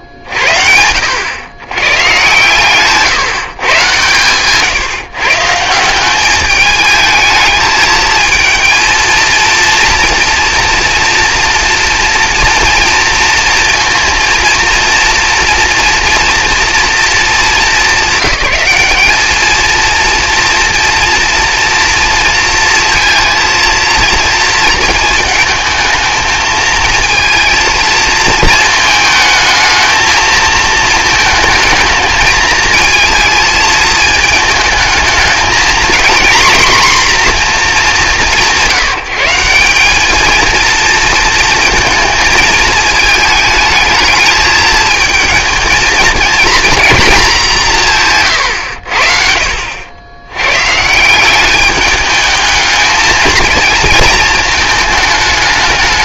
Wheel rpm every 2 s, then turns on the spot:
50, 130, 140, 210, 220, 230, 230, 230, 230, 200, 230, 230, 220, 220, 220, 220, 220, 220, 240, 140, 220, 220, 220, 230, 90, 130, 220, 220.
48-50